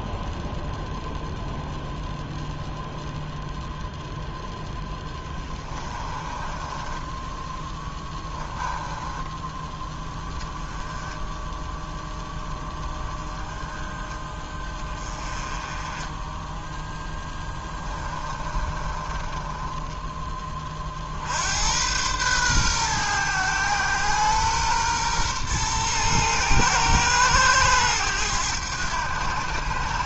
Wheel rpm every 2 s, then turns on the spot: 0, 0, 10, 10, 10, 10, 10, 20, 10, 30, 60, 120, 120, 110, 100.
4-10 16-20